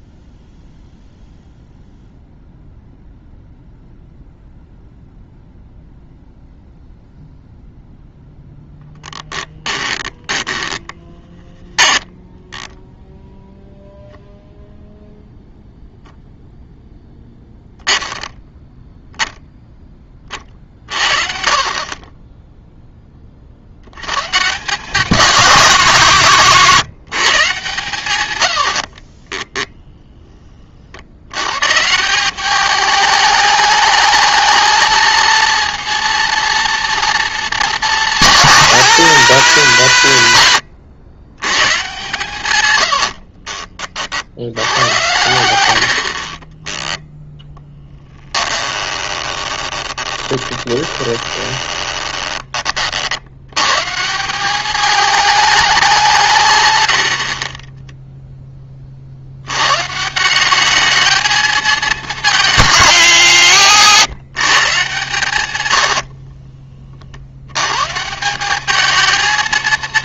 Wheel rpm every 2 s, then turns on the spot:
0, 0, 0, 0, 0, 10, 0, 0, 0, 0, 50, 10, 160, 150, 90, 40, 210, 220, 230, 160, 80, 110, 90, 10, 20, 20, 30, 200, 130, 20, 200, 210, 150, 30, 210.
10-12 28-30 40-42 46-52